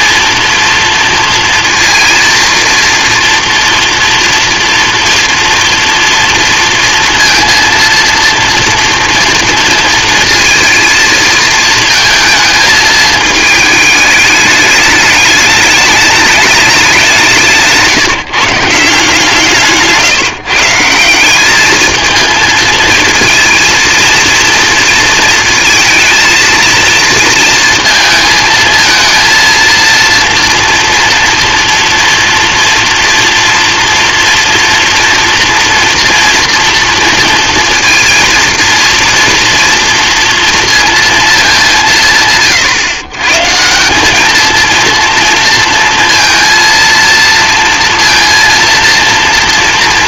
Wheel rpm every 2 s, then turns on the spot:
230, 230, 230, 230, 230, 230, 220, 210, 210, 160, 160, 230, 230, 230, 220, 230, 230, 230, 230, 230, 230, 140, 220, 230, 230.
none